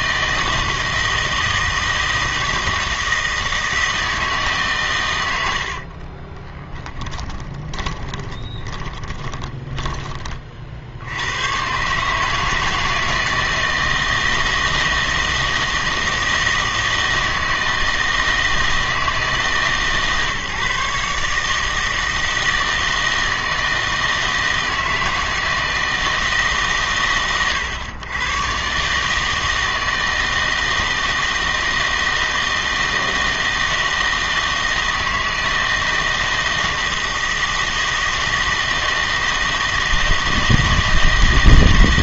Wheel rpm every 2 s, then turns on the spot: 160, 160, 150, 20, 20, 40, 160, 160, 160, 160, 140, 160, 160, 140, 130, 160, 160, 160, 160, 160, 160.
6-10